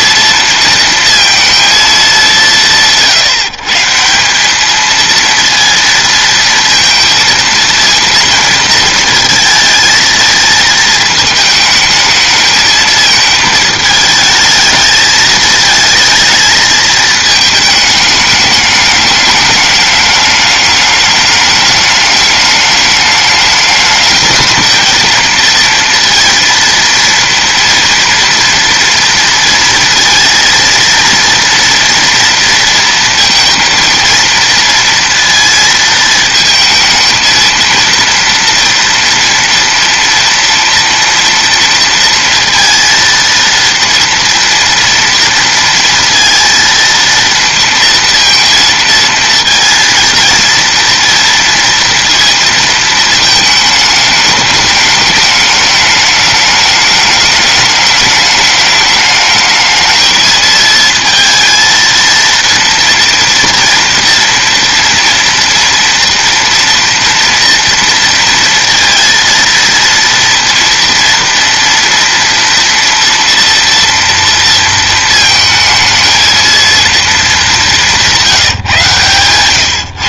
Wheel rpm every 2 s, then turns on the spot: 230, 170, 210, 230, 230, 220, 220, 220, 220, 210, 210, 210, 220, 230, 230, 230, 230, 230, 220, 230, 230, 230, 240, 230, 230, 230, 220, 210, 210, 210, 220, 230, 230, 230, 230, 230, 230, 230, 230, 150.
none